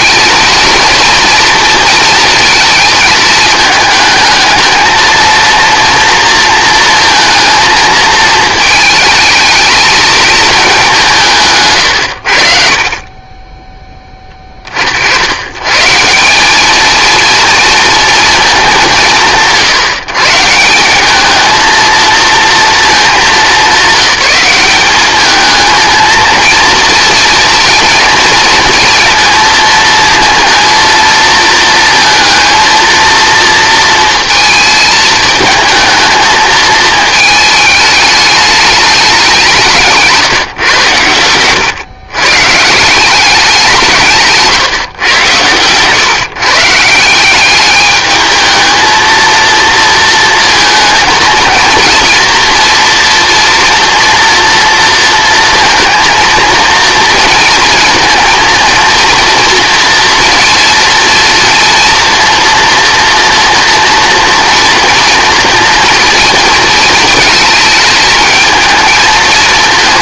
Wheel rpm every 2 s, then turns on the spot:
240, 230, 220, 230, 220, 210, 60, 50, 210, 190, 170, 220, 190, 240, 230, 230, 230, 220, 220, 210, 140, 160, 140, 160, 220, 230, 230, 230, 230, 230, 230, 240, 240, 220, 220.
none